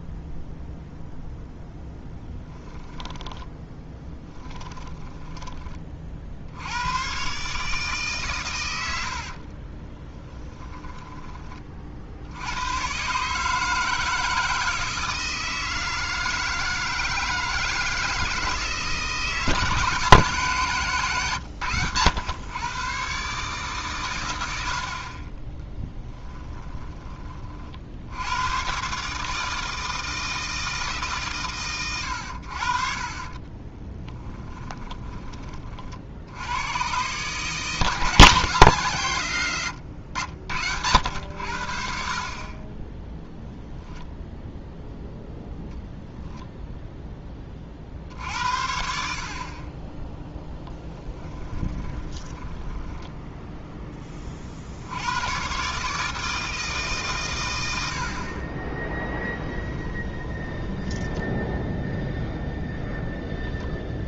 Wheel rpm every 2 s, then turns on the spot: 0, 10, 10, 90, 90, 10, 120, 160, 160, 160, 140, 130, 60, 10, 120, 150, 50, 20, 110, 110, 80, 10, 0, 0, 70, 10, 10, 70, 150, 20, 10, 0.
2-6 10-12 32-36 50-54 60-62